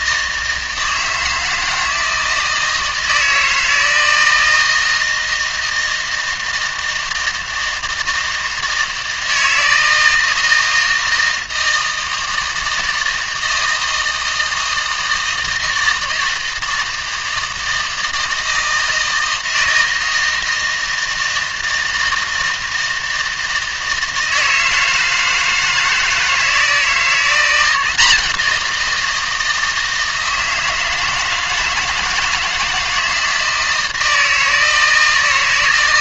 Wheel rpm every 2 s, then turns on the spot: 160, 160, 160, 160, 160, 160, 160, 160, 160, 160, 160, 160, 160, 160, 170, 160, 160, 160.
none